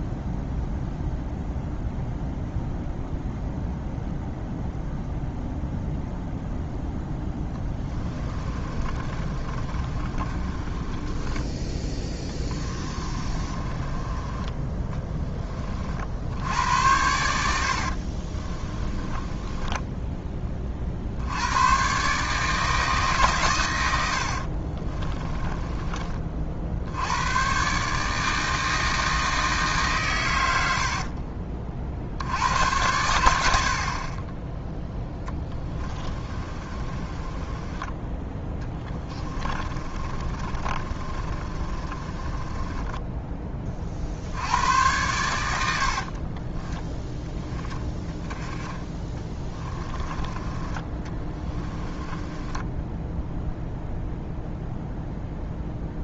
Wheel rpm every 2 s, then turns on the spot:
0, 0, 0, 0, 30, 20, 20, 10, 90, 30, 30, 160, 40, 60, 160, 90, 90, 10, 30, 10, 30, 20, 100, 20, 10, 20, 0, 0.
8-14 18-20 24-26 30-32 36-44